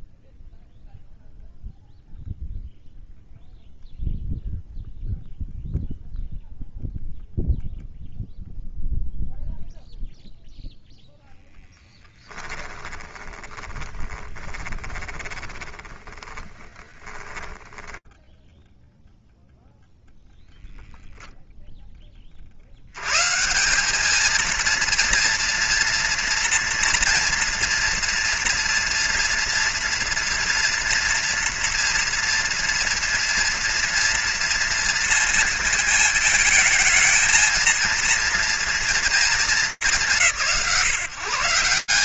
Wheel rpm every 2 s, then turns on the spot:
0, 0, 0, 0, 0, 10, 20, 20, 20, 0, 0, 170, 230, 230, 230, 230, 230, 230, 230, 210, 140.
10-18